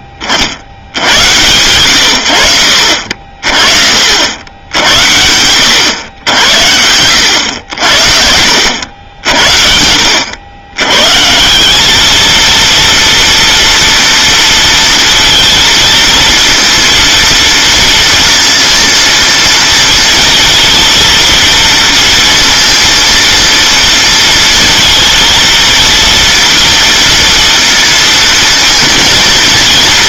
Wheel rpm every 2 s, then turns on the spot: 50, 90, 80, 90, 70, 100, 230, 230, 230, 230, 230, 230, 230, 230, 230.
none